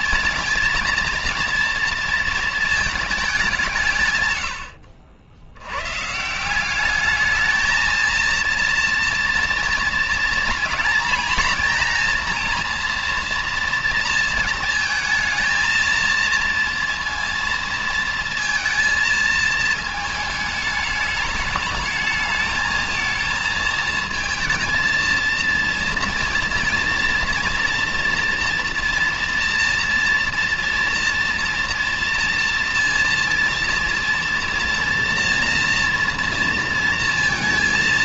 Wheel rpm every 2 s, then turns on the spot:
230, 230, 110, 170, 230, 230, 230, 230, 230, 230, 210, 220, 230, 230, 230, 230, 230, 230, 230.
none